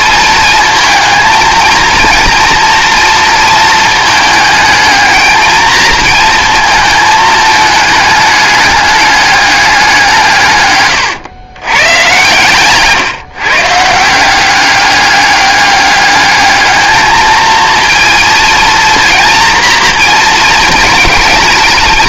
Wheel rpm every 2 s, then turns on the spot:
230, 230, 220, 220, 210, 120, 130, 200, 220, 230, 220.
10-12